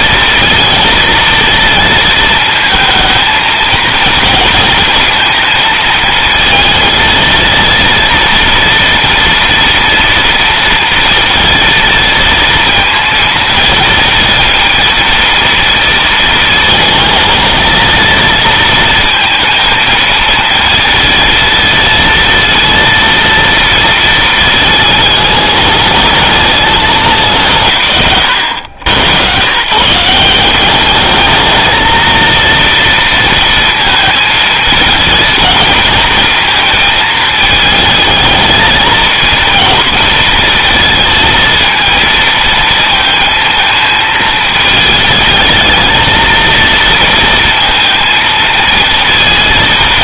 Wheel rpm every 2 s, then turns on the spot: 230, 220, 230, 220, 230, 230, 230, 230, 220, 230, 230, 230, 220, 210, 100, 210, 230, 230, 220, 220, 230, 230, 220, 230, 230.
none